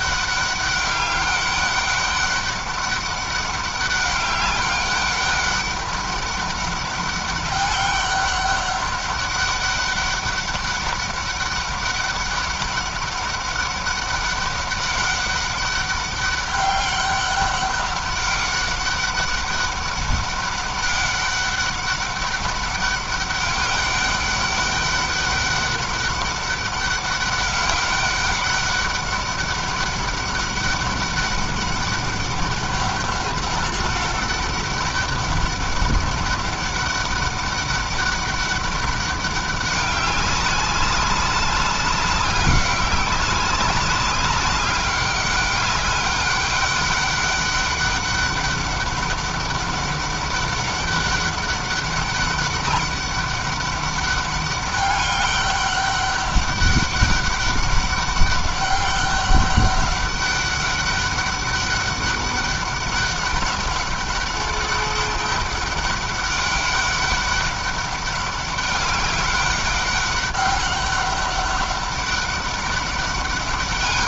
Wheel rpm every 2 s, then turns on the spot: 200, 200, 200, 200, 200, 200, 200, 200, 200, 200, 200, 200, 200, 200, 200, 200, 200, 200, 200, 190, 190, 190, 200, 200, 200, 200, 200, 200, 200, 200, 200, 200, 200, 200, 200, 200, 200.
none